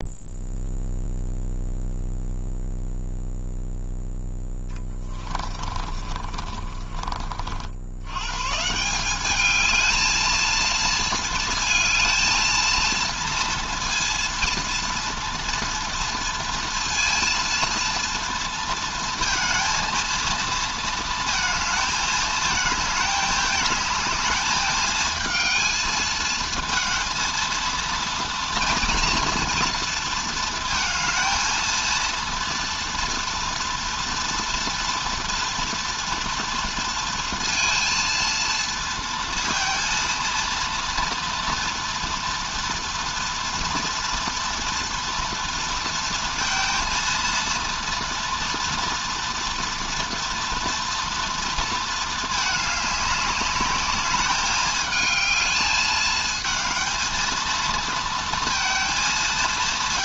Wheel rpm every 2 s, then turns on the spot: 0, 0, 20, 30, 180, 220, 230, 240, 230, 230, 220, 210, 220, 230, 230, 220, 230, 230, 230, 220, 230, 230, 230, 230, 240, 230, 210, 220, 230, 230.
4-6